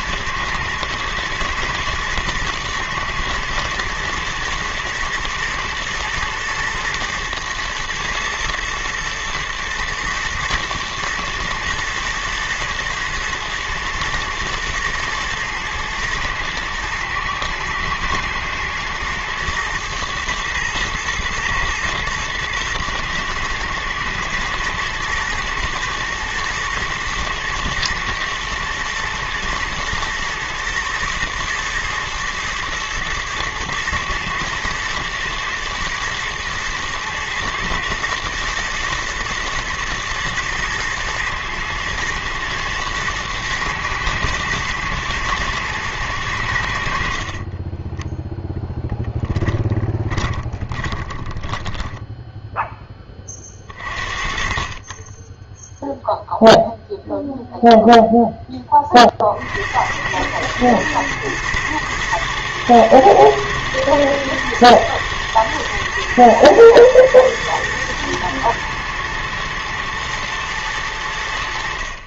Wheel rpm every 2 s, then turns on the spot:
110, 110, 110, 120, 110, 110, 110, 110, 110, 110, 120, 120, 110, 110, 120, 110, 110, 110, 110, 120, 110, 110, 110, 90, 0, 20, 0, 40, 0, 10, 110, 120, 120, 110, 120, 110.
50-52